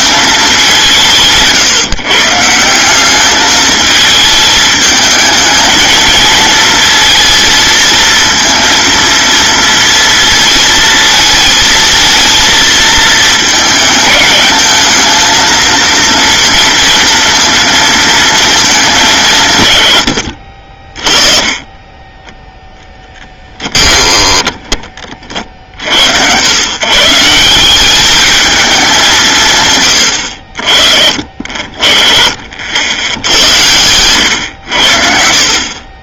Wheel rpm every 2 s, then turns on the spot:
180, 180, 220, 230, 230, 220, 220, 220, 230, 200, 40, 10, 40, 140, 200, 60, 70, 80.
22-24